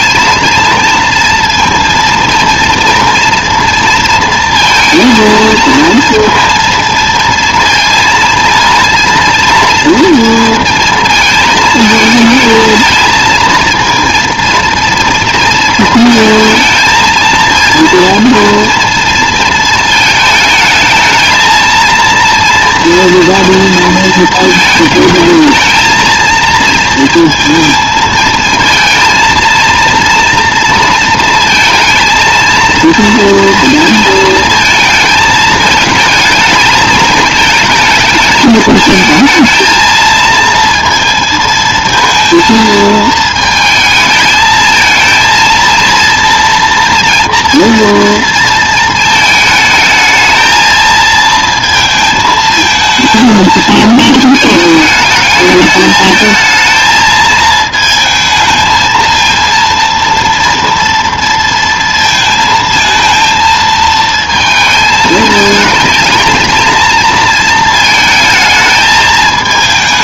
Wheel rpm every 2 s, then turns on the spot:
230, 240, 230, 230, 230, 220, 220, 230, 220, 230, 210, 230, 220, 220, 220, 230, 230, 220, 220, 220, 220, 220, 220, 230, 230, 220, 220, 220, 220, 220, 230, 220, 220, 220, 220.
none